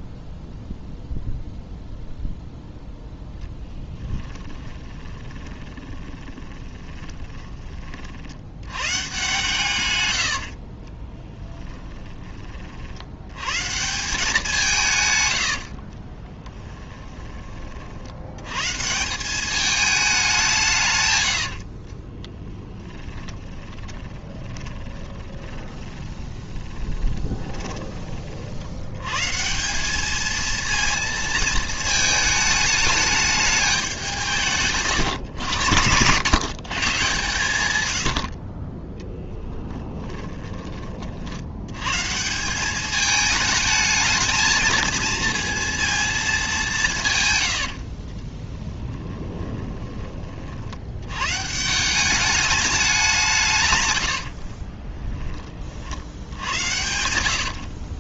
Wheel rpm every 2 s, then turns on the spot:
0, 0, 20, 20, 110, 40, 60, 160, 20, 130, 150, 10, 20, 20, 90, 220, 210, 140, 130, 20, 30, 200, 220, 200, 10, 70, 200, 40, 70.
4-8 10-12 16-18 22-28 48-50 54-58